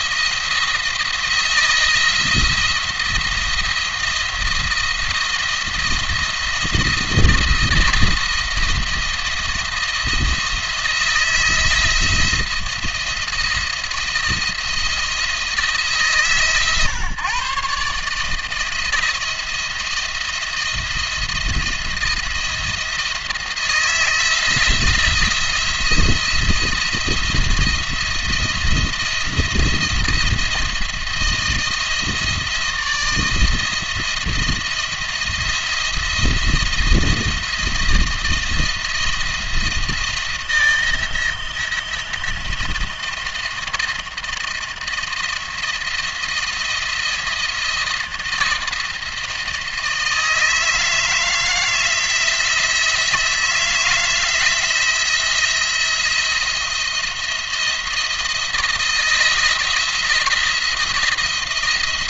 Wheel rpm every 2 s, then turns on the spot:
170, 170, 170, 170, 170, 170, 170, 170, 140, 160, 170, 170, 170, 170, 170, 170, 160, 170, 170, 170, 170, 170, 160, 170, 170, 160, 170, 160, 170, 170, 170.
none